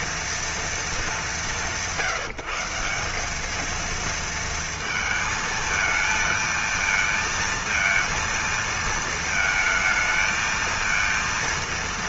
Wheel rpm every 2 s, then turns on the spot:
230, 180, 230, 220, 230, 220.
none